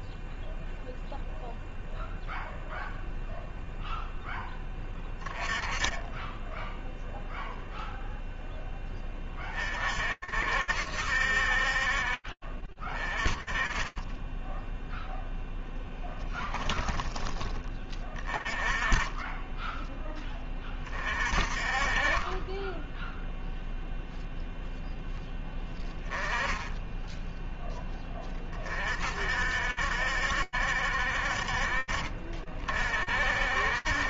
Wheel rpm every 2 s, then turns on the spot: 0, 0, 10, 0, 10, 70, 20, 10, 10, 30, 40, 10, 10, 0, 50, 50, 50.
none